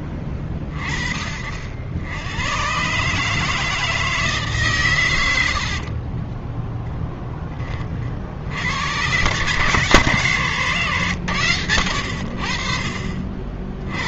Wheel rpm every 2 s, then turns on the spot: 40, 120, 150, 20, 80, 110, 60.
6-8